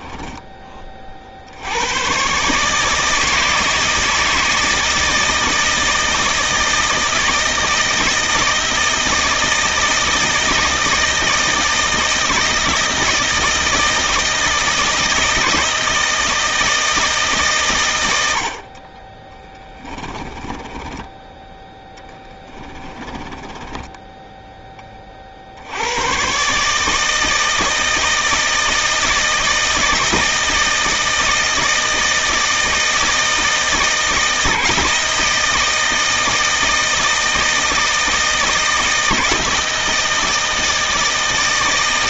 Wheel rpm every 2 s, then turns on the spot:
20, 150, 160, 160, 160, 160, 160, 160, 160, 40, 10, 20, 20, 150, 160, 160, 160, 160, 160, 160, 160.
20-24